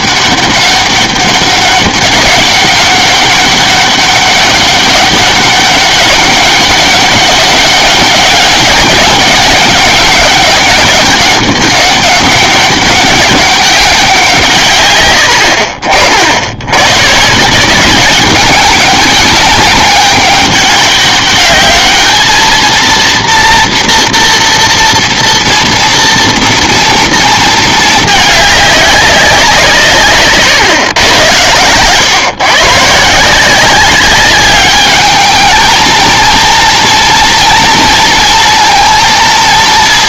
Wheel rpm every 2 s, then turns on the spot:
200, 200, 200, 200, 190, 210, 200, 150, 100, 200, 200, 220, 230, 230, 210, 130, 140, 200, 230, 230.
none